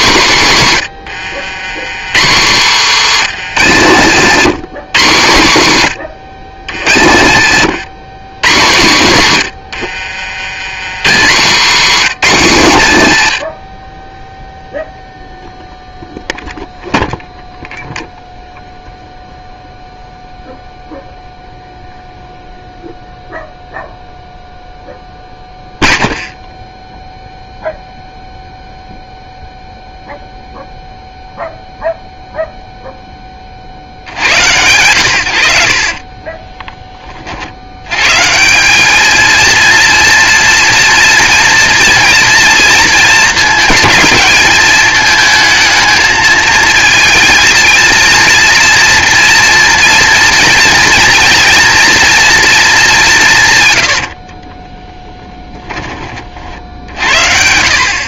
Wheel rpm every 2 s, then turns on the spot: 120, 130, 150, 100, 130, 90, 130, 0, 0, 0, 0, 0, 0, 0, 0, 0, 0, 100, 20, 190, 230, 230, 220, 230, 240, 230, 210, 20, 60.
2-4 6-8 54-56